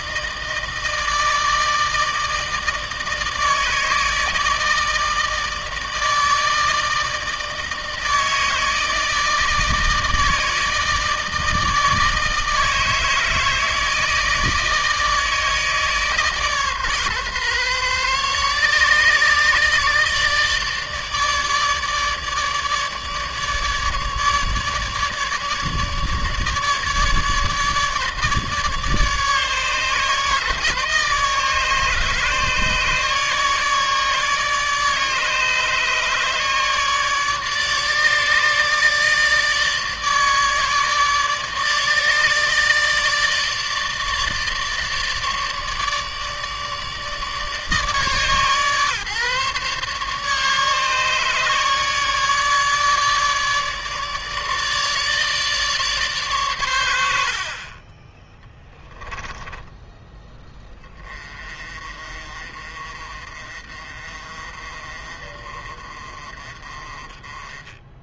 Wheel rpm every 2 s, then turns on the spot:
160, 160, 160, 160, 160, 160, 160, 160, 140, 150, 150, 150, 150, 150, 150, 150, 150, 150, 150, 150, 150, 150, 150, 150, 140, 150, 150, 150, 90, 10, 20, 40, 40, 30.
none